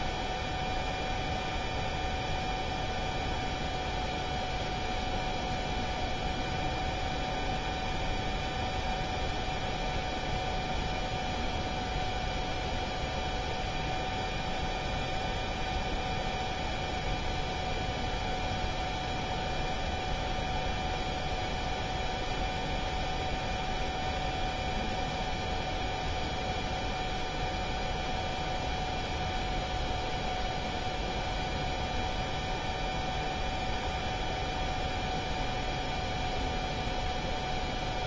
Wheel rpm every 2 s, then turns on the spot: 0, 0, 0, 0, 0, 0, 0, 0, 0, 0, 0, 0, 0, 0, 0, 0, 0, 0, 0.
none